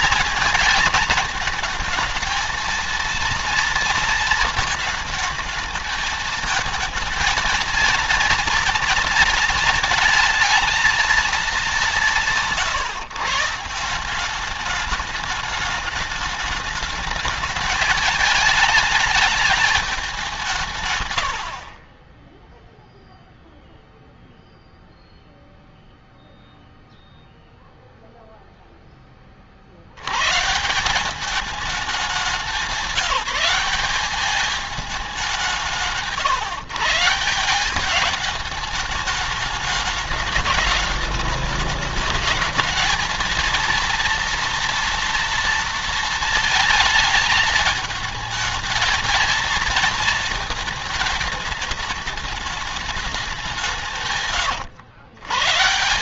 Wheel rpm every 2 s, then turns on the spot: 230, 230, 220, 220, 230, 220, 140, 210, 210, 210, 130, 0, 0, 0, 20, 180, 190, 190, 160, 210, 210, 220, 230, 220, 230, 220, 190, 150.
none